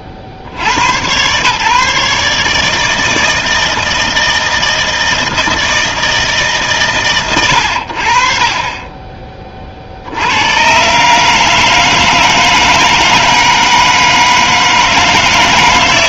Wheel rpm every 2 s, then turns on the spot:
80, 160, 160, 150, 40, 100, 160, 160.
none